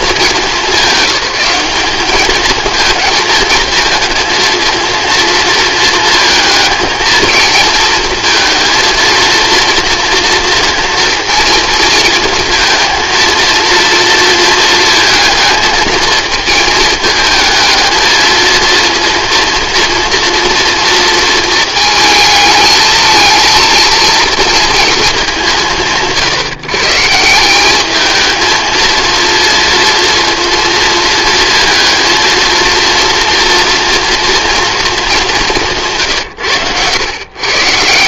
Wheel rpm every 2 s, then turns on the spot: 200, 220, 230, 220, 230, 230, 230, 230, 220, 230, 230, 220, 230, 140, 220, 230, 230, 240, 100.
none